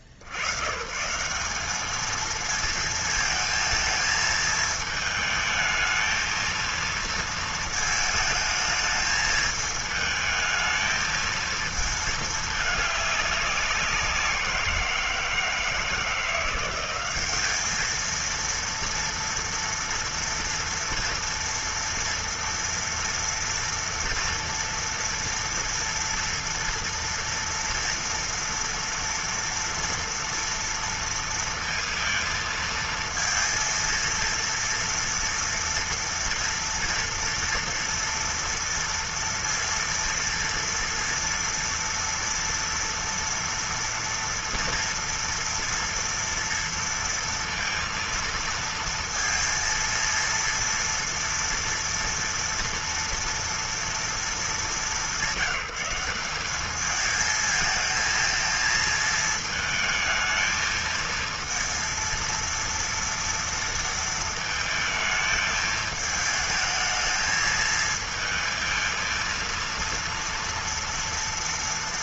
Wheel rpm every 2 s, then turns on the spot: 80, 220, 220, 230, 220, 220, 210, 180, 170, 230, 230, 230, 230, 230, 230, 230, 230, 230, 230, 230, 230, 230, 230, 230, 230, 230, 230, 210, 200, 220, 220, 230, 230, 220, 220, 230.
none